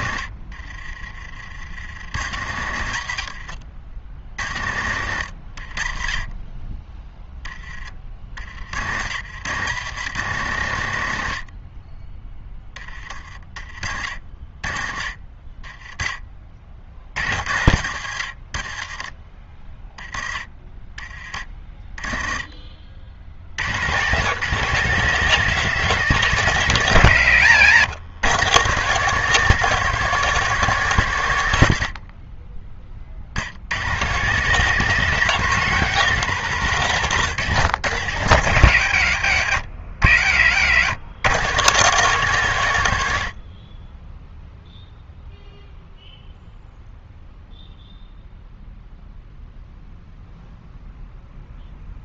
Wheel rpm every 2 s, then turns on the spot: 40, 70, 60, 10, 70, 90, 20, 40, 50, 40, 20, 60, 180, 150, 160, 150, 30, 190, 160, 100, 100, 100, 0, 0, 0, 0.
0-4